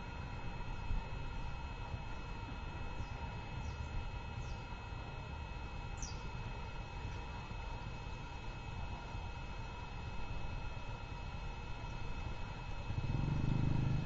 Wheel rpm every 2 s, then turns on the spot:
0, 0, 0, 0, 0, 0, 0.
none